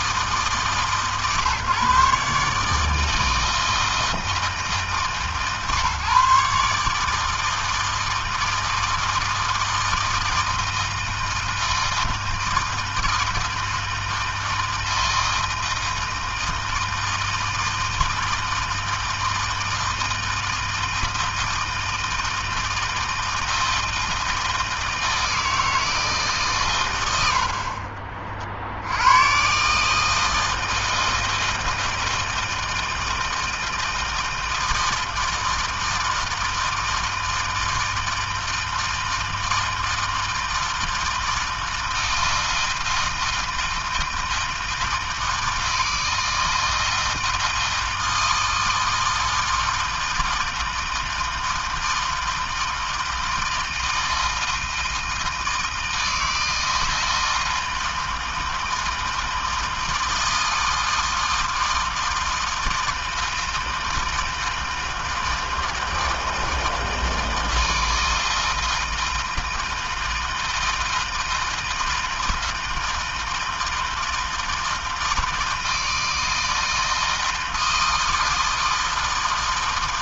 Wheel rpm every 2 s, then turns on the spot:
140, 160, 150, 160, 160, 160, 160, 160, 160, 160, 160, 160, 160, 90, 100, 160, 160, 160, 160, 160, 160, 160, 160, 160, 160, 160, 160, 160, 160, 160, 160, 160, 160, 160, 160, 160, 160, 160, 160, 160.
none